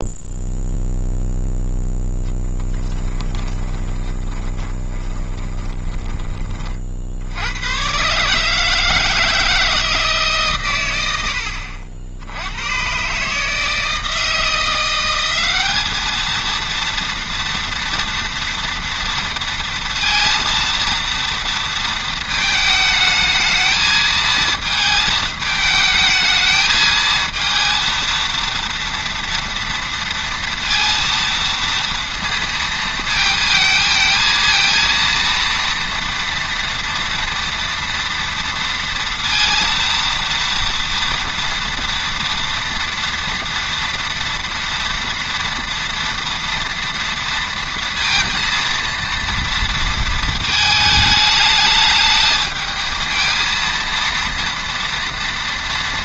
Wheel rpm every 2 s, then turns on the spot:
0, 10, 20, 40, 150, 130, 100, 160, 220, 230, 230, 220, 220, 220, 230, 230, 230, 230, 230, 230, 240, 230, 230, 230, 230, 220, 220, 230.
2-6